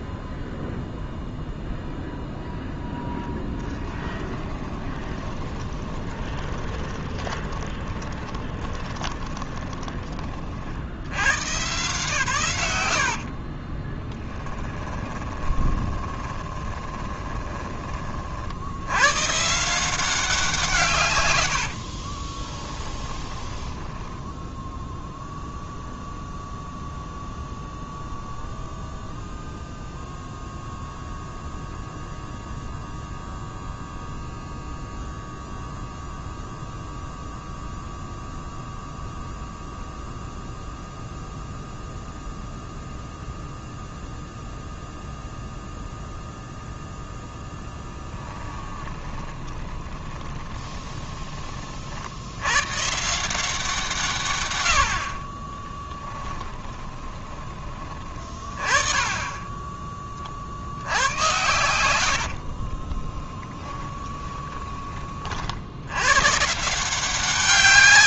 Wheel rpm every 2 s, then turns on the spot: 0, 0, 20, 20, 20, 50, 110, 10, 20, 70, 170, 20, 0, 0, 0, 0, 0, 0, 0, 0, 0, 0, 0, 0, 10, 20, 110, 90, 20, 20, 60, 50, 10, 150.
4-10 14-18 22-24 48-52 56-58 62-64